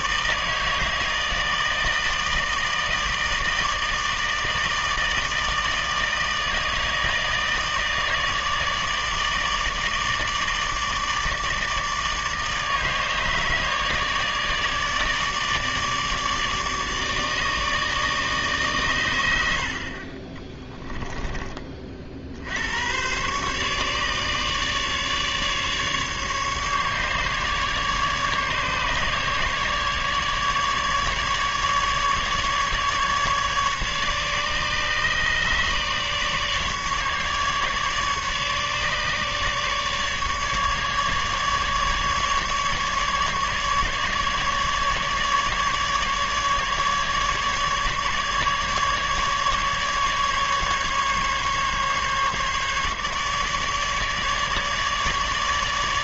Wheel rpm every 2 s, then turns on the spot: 160, 160, 160, 160, 150, 150, 150, 150, 150, 130, 20, 90, 150, 150, 150, 150, 150, 150, 150, 150, 150, 150, 150, 150, 150, 140, 150, 150.
20-22